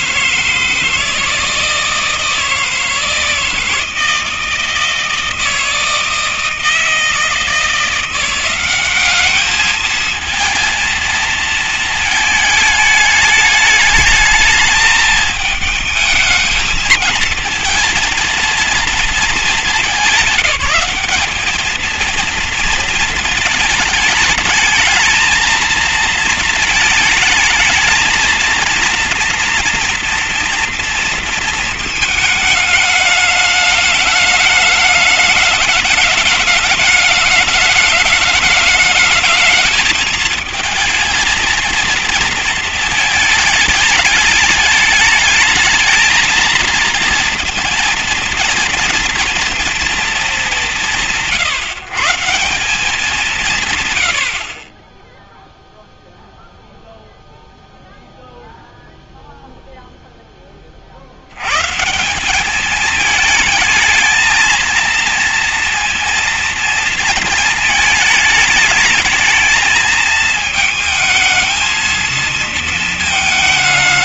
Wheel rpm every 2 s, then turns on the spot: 160, 160, 160, 160, 200, 220, 220, 220, 220, 230, 210, 220, 220, 230, 230, 230, 210, 210, 210, 210, 230, 220, 210, 220, 230, 140, 180, 10, 0, 0, 40, 210, 230, 220, 220, 220, 220.
none